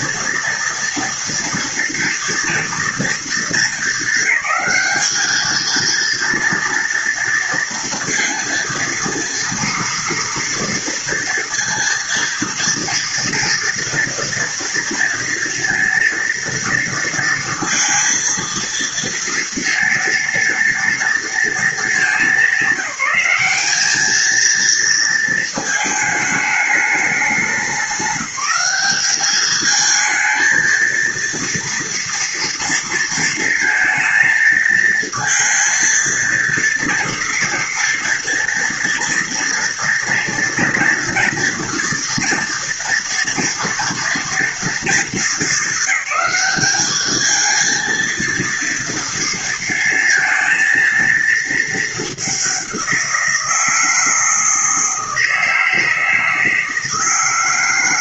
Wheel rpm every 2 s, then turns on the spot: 230, 230, 200, 230, 230, 230, 230, 230, 230, 230, 230, 200, 220, 210, 200, 230, 230, 220, 230, 230, 230, 230, 230, 210, 230, 230, 190, 160, 160.
none